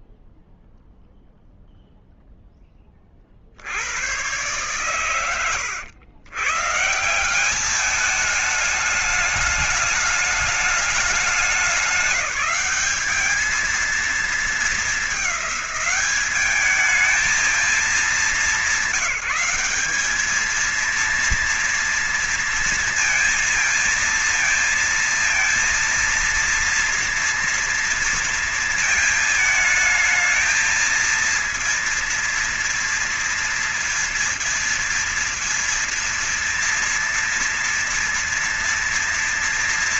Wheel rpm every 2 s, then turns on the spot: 0, 0, 80, 100, 190, 210, 200, 220, 210, 210, 200, 230, 230, 230, 230, 220, 230, 230, 230, 230.
none